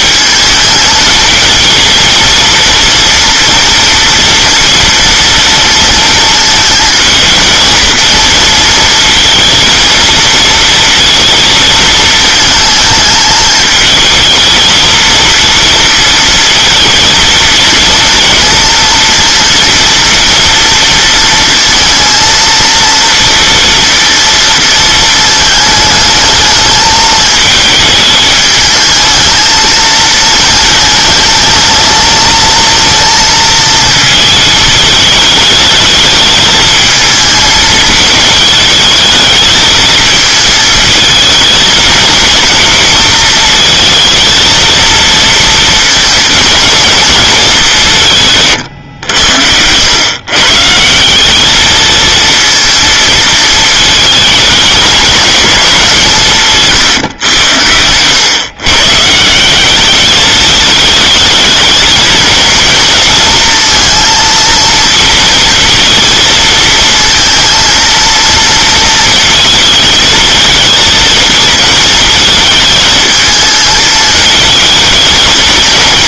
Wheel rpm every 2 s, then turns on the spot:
220, 230, 230, 220, 230, 230, 220, 220, 230, 240, 230, 230, 230, 220, 220, 220, 230, 220, 220, 220, 220, 230, 230, 240, 130, 160, 230, 220, 140, 130, 220, 230, 230, 230, 230, 220, 220, 230.
none